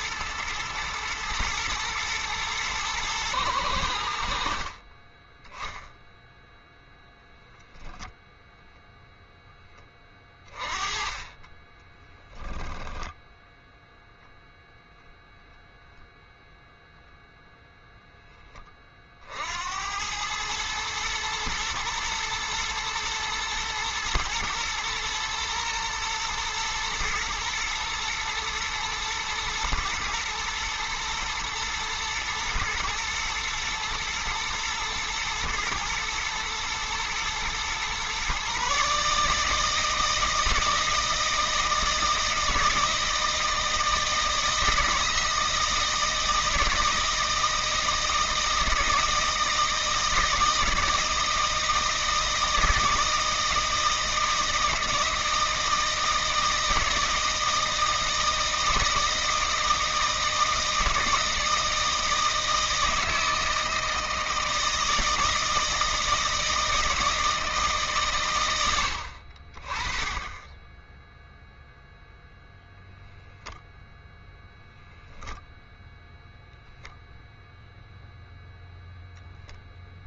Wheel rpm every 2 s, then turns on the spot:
110, 120, 50, 0, 0, 20, 10, 0, 0, 30, 110, 120, 120, 120, 110, 120, 120, 120, 110, 140, 160, 160, 160, 160, 160, 160, 160, 160, 160, 160, 160, 160, 160, 160, 100, 10, 0, 0, 0, 10.
12-14